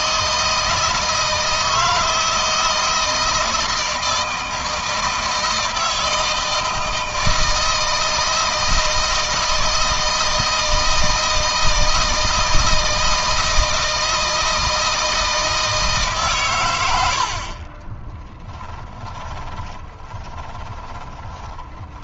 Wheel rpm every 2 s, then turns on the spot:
160, 160, 160, 160, 160, 160, 160, 160, 110, 20, 20.
18-22